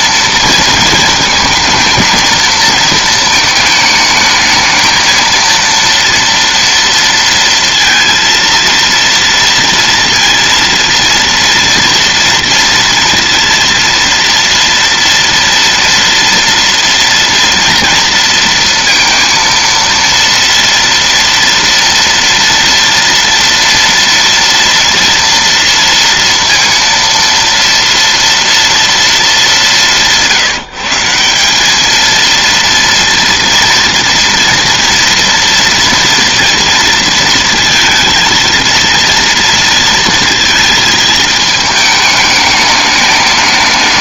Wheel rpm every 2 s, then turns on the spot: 230, 230, 220, 230, 230, 230, 230, 230, 230, 230, 230, 230, 230, 230, 230, 170, 230, 240, 230, 230, 230, 210.
none